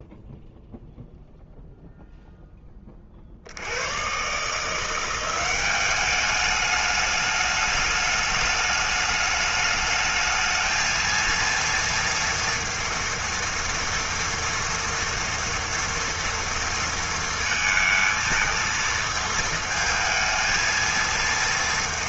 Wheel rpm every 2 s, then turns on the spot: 0, 20, 160, 210, 210, 220, 230, 240, 230, 220, 230.
none